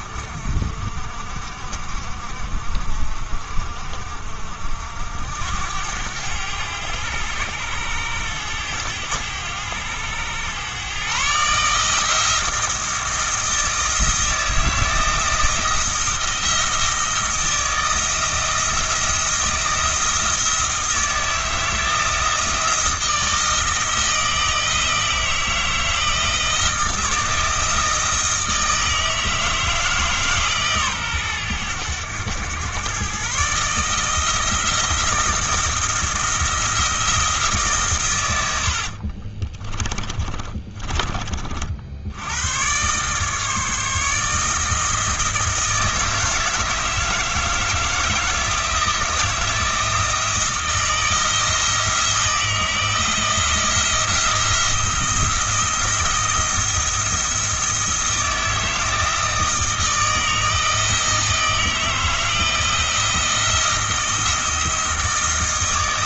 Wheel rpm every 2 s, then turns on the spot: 60, 50, 60, 100, 100, 120, 160, 170, 170, 170, 160, 160, 160, 160, 160, 130, 120, 170, 170, 70, 30, 110, 160, 160, 160, 170, 170, 170, 170, 160, 160, 160, 160.
38-42